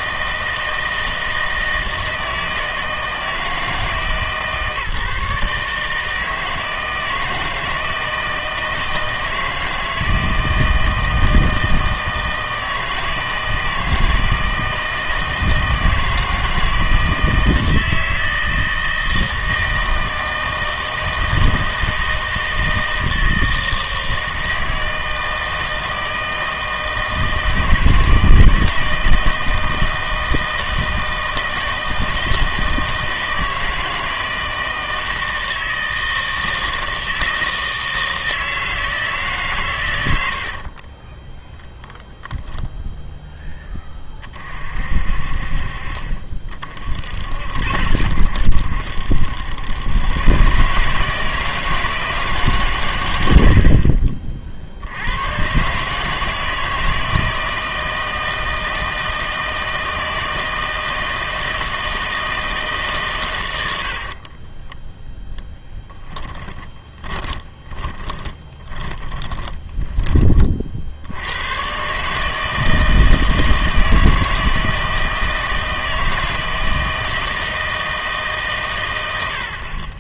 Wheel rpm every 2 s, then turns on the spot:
160, 160, 150, 160, 160, 160, 160, 160, 160, 160, 160, 160, 160, 160, 160, 160, 160, 160, 160, 160, 40, 0, 50, 50, 80, 140, 130, 50, 160, 160, 160, 160, 20, 20, 20, 40, 160, 160, 160, 120.
40-42 64-70